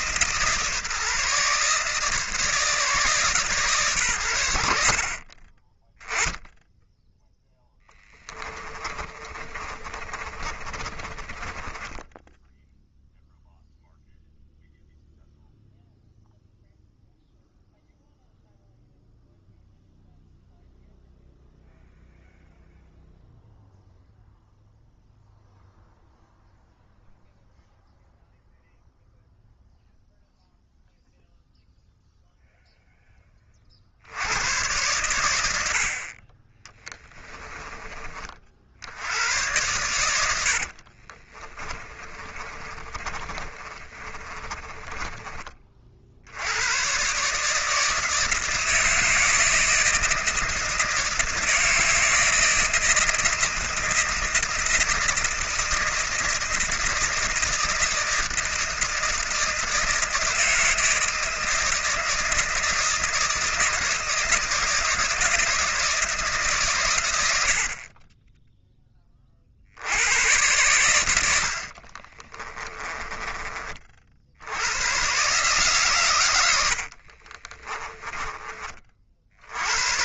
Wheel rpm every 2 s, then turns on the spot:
150, 160, 80, 10, 30, 40, 0, 0, 0, 0, 0, 0, 0, 0, 0, 0, 0, 90, 20, 60, 60, 30, 30, 110, 160, 160, 160, 160, 160, 160, 160, 160, 160, 140, 10, 100, 20, 100, 70, 40.
8-12 36-38 40-46 72-74 76-78